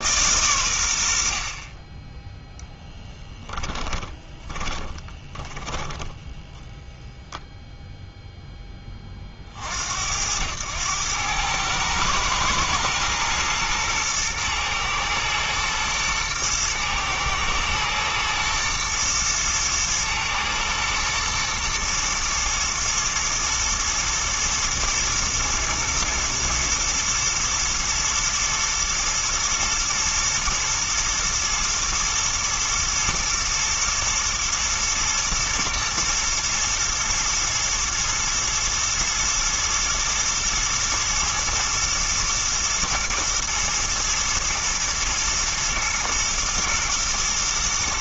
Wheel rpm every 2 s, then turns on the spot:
110, 10, 20, 0, 0, 100, 110, 110, 110, 120, 110, 110, 120, 110, 110, 120, 110, 110, 110, 110, 110, 110, 120, 120.
4-6